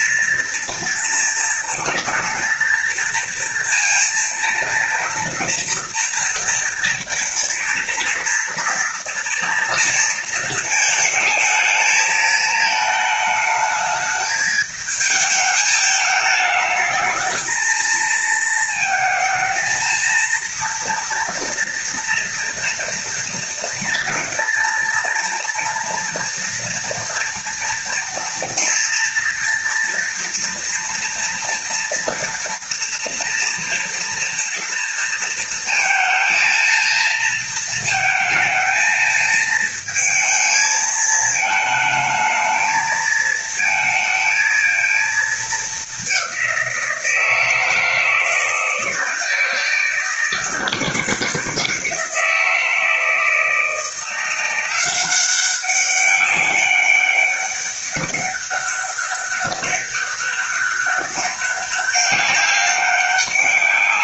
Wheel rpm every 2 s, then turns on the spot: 230, 230, 230, 230, 230, 220, 220, 220, 220, 220, 230, 230, 230, 230, 240, 240, 230, 230, 230, 230, 220, 220, 220, 170, 160, 170, 160, 180, 200, 200, 200, 200.
none